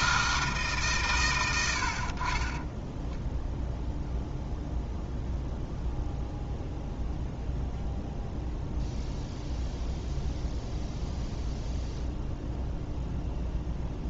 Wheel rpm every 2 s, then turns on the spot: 150, 10, 0, 0, 0, 0, 0.
2-4